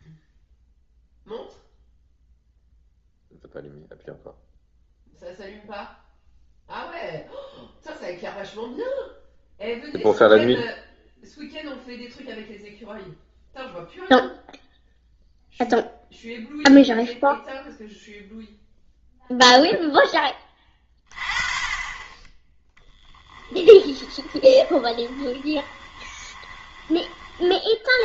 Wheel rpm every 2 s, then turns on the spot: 0, 0, 0, 0, 0, 0, 0, 0, 0, 0, 20, 10, 20, 20.
24-28